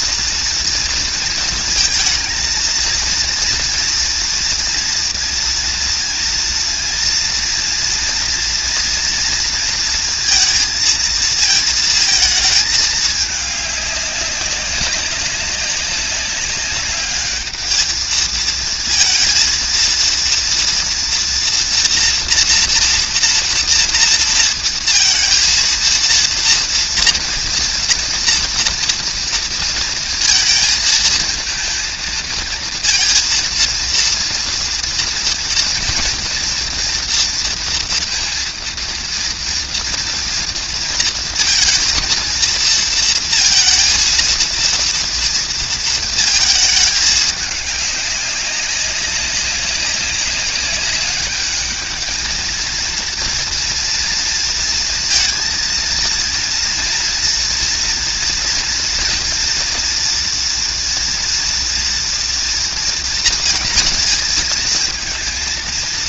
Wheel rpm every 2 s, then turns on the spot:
240, 230, 230, 230, 230, 230, 220, 190, 200, 220, 230, 240, 230, 230, 230, 220, 230, 230, 230, 230, 230, 230, 230, 220, 200, 200, 220, 230, 230, 230, 230, 230, 220.
none